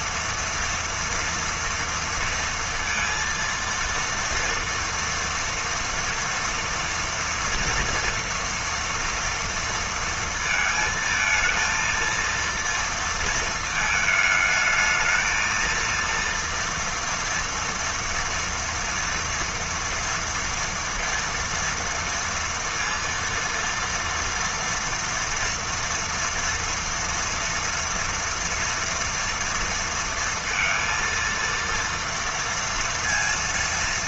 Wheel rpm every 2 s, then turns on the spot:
230, 230, 230, 230, 230, 230, 230, 220, 230, 230, 230, 230, 230, 230, 240, 230, 230.
none